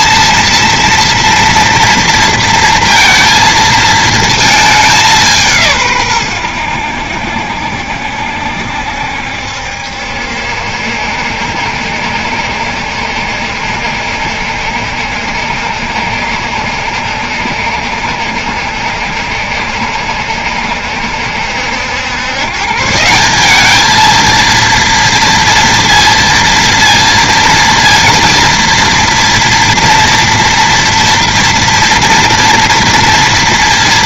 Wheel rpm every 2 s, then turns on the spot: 230, 230, 210, 90, 70, 70, 60, 70, 70, 70, 70, 140, 230, 230, 230, 230, 230.
none